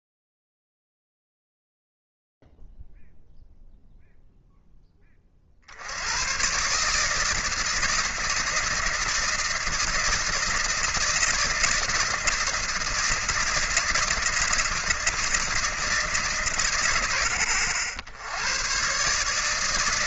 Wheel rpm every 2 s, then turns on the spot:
0, 0, 0, 110, 160, 160, 160, 160, 130, 90.
none